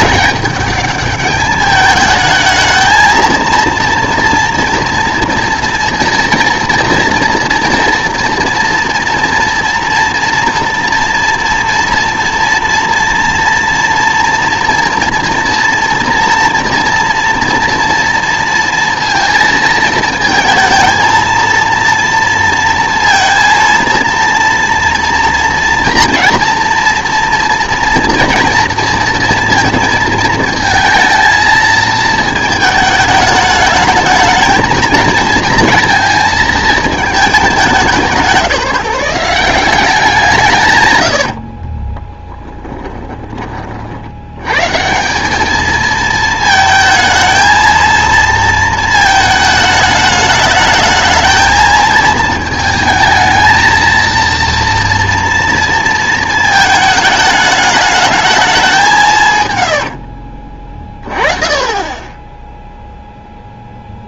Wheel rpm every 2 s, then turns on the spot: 210, 220, 240, 230, 230, 230, 230, 230, 230, 230, 220, 230, 230, 240, 230, 230, 220, 230, 220, 190, 140, 10, 140, 220, 220, 210, 220, 230, 220, 190, 30, 0.
42-44